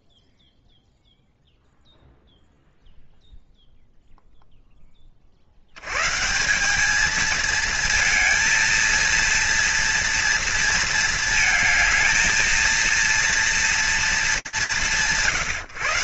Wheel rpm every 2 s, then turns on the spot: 0, 0, 30, 210, 230, 220, 230, 140.
none